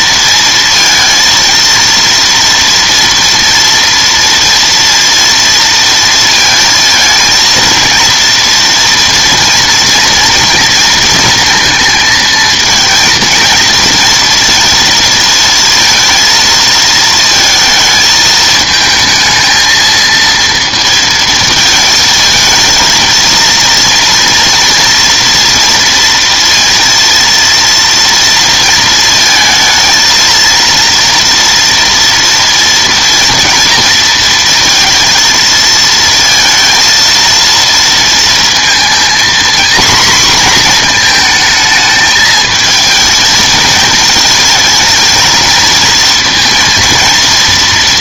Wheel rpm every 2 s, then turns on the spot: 230, 230, 230, 230, 230, 230, 230, 230, 230, 220, 230, 230, 240, 230, 230, 230, 230, 230, 230, 230, 240, 220, 230, 230.
none